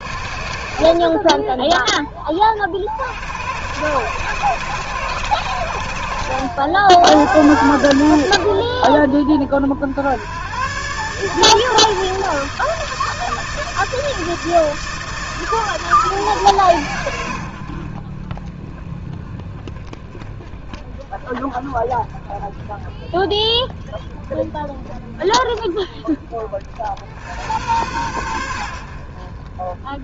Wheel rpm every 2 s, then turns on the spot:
70, 30, 120, 90, 90, 90, 160, 160, 150, 40, 20, 20, 20, 30, 90.
none